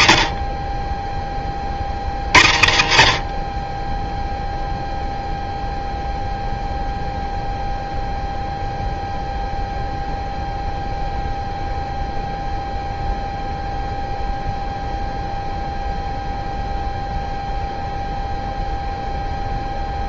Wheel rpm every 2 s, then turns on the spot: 10, 50, 0, 0, 0, 0, 0, 0, 0, 0.
none